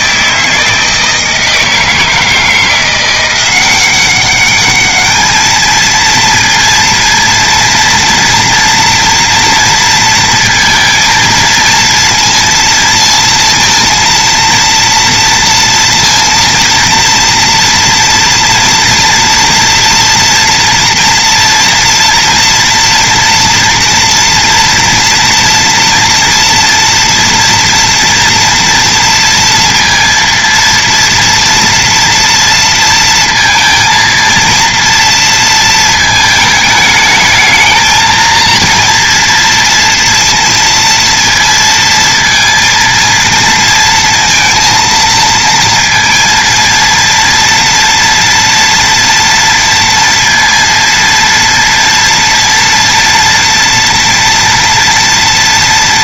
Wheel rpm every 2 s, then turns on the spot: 160, 170, 200, 230, 230, 230, 230, 230, 230, 240, 230, 240, 230, 240, 230, 230, 230, 230, 220, 230, 230, 230, 230, 230, 230, 230, 230, 230.
none